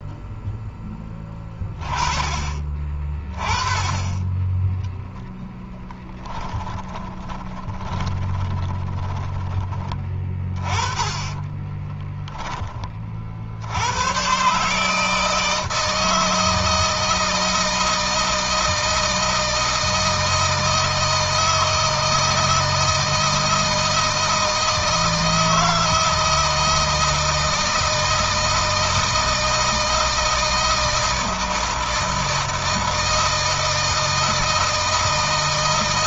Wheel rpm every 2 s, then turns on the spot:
10, 30, 0, 20, 20, 20, 40, 150, 160, 160, 160, 160, 160, 160, 160, 160, 160, 160.
6-10